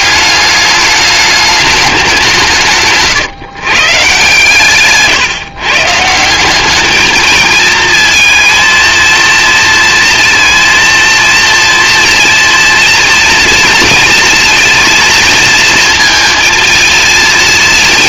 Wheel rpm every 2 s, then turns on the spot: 210, 150, 140, 220, 230, 230, 230, 230, 230.
none